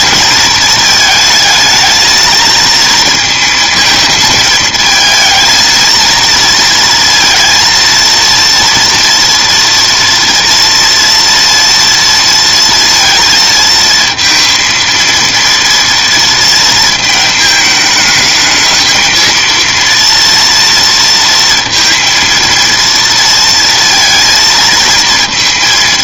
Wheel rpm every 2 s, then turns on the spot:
220, 230, 220, 230, 230, 230, 230, 230, 230, 220, 230, 230, 220.
none